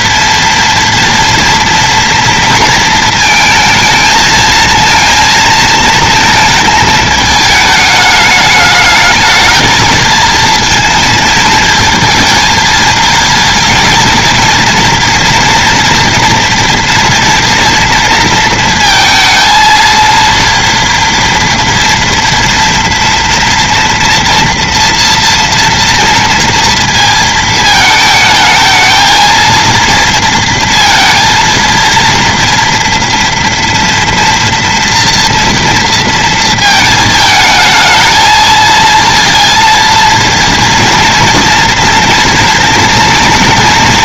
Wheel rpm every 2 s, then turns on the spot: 230, 220, 220, 220, 210, 220, 220, 230, 230, 230, 230, 240, 230, 230, 220, 230, 230, 230, 220, 230, 230, 230.
none